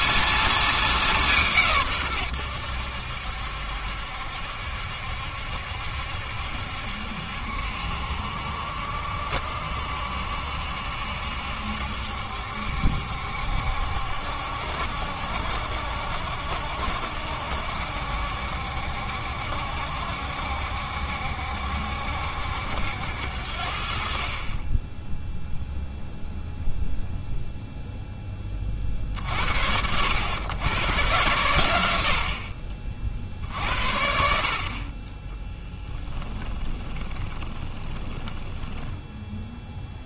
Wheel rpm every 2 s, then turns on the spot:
220, 90, 70, 70, 70, 70, 70, 60, 70, 70, 70, 70, 30, 0, 20, 110, 40, 50, 20, 10.
36-40